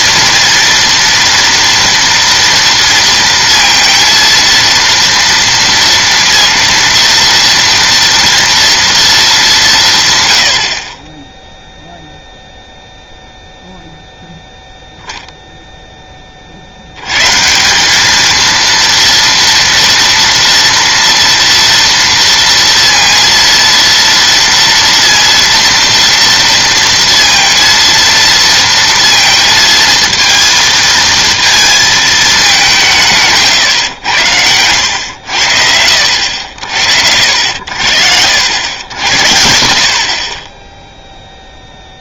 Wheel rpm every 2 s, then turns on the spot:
230, 230, 230, 230, 230, 50, 0, 0, 70, 230, 230, 230, 230, 230, 230, 230, 170, 90, 70, 80, 0.
none